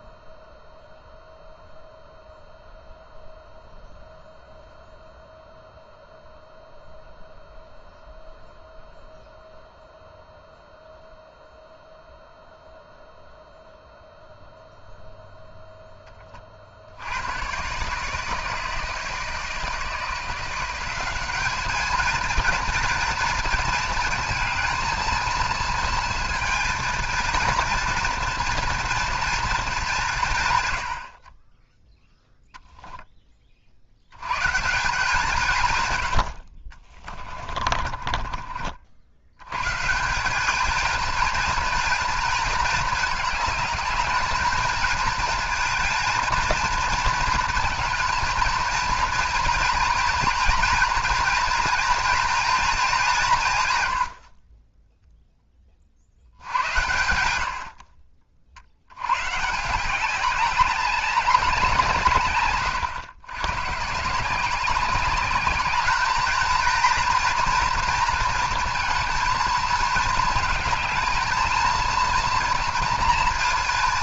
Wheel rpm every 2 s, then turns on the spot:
0, 0, 0, 0, 0, 0, 0, 0, 60, 160, 180, 230, 220, 230, 230, 90, 0, 160, 30, 50, 220, 210, 220, 230, 230, 230, 210, 10, 90, 80, 200, 110, 190, 230, 230, 220, 230.
36-38